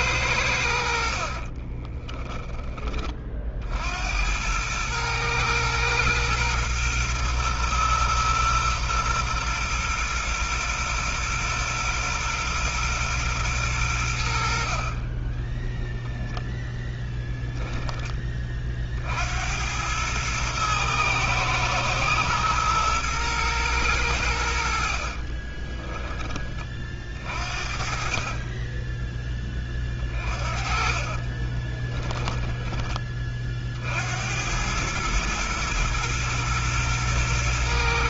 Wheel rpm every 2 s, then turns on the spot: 80, 20, 100, 120, 120, 120, 120, 50, 0, 40, 110, 120, 70, 30, 20, 40, 10, 100, 120.
0-2 24-26 30-32